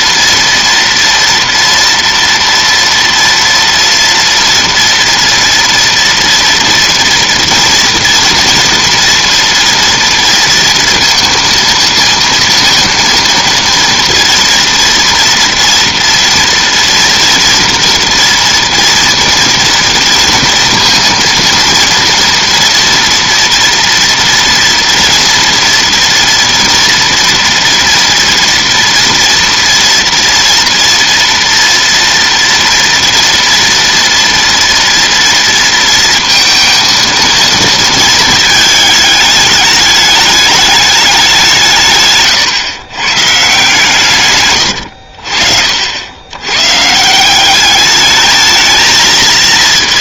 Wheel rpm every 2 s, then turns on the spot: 230, 230, 240, 240, 240, 230, 230, 230, 230, 230, 230, 230, 230, 230, 230, 230, 230, 230, 230, 220, 210, 120, 110, 130, 220.
none